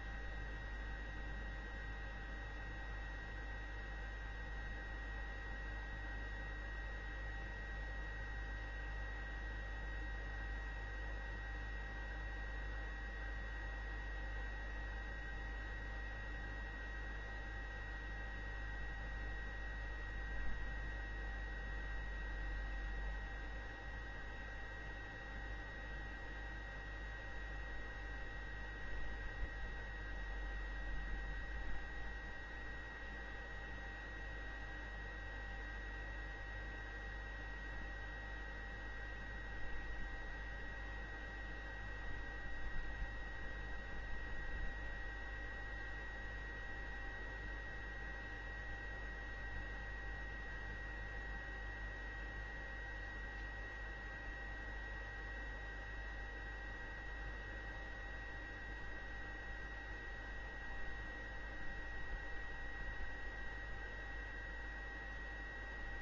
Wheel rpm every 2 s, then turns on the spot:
0, 0, 0, 0, 0, 0, 0, 0, 0, 0, 0, 0, 0, 0, 0, 0, 0, 0, 0, 0, 0, 0, 0, 0, 0, 0, 0, 0, 0, 0, 0, 0, 0.
none